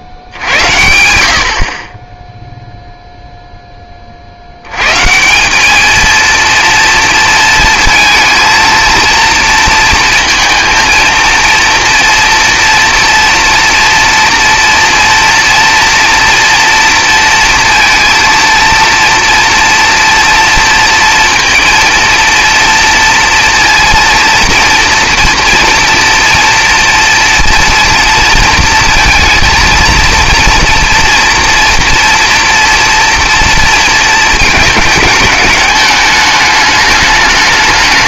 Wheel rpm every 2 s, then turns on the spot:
50, 0, 80, 230, 230, 230, 230, 230, 230, 230, 230, 230, 230, 230, 230, 230, 230, 220, 210.
none